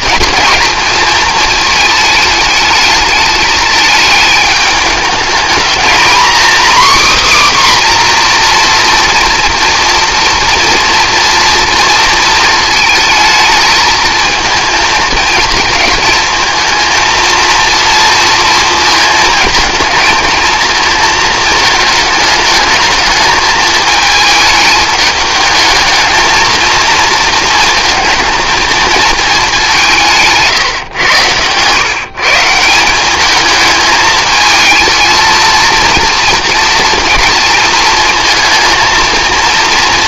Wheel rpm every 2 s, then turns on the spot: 230, 210, 210, 260, 240, 230, 220, 220, 220, 220, 220, 210, 220, 230, 220, 140, 170, 220, 230, 230.
none